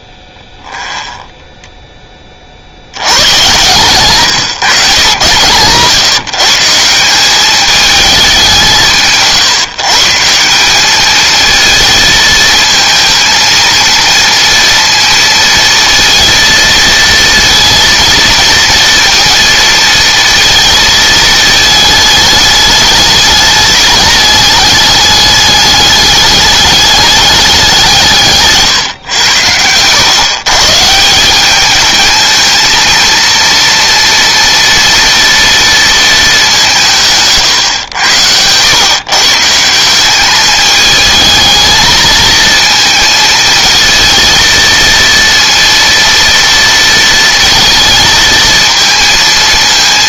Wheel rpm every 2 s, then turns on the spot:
20, 70, 120, 170, 170, 200, 230, 230, 230, 230, 230, 210, 210, 200, 150, 150, 230, 230, 170, 130, 220, 220, 230, 230, 230.
none